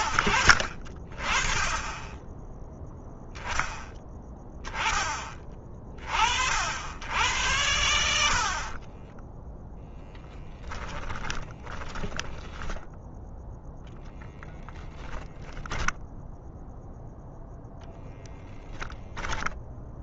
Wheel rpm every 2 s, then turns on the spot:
40, 0, 20, 90, 30, 20, 10, 10, 0, 10.
8-12 18-20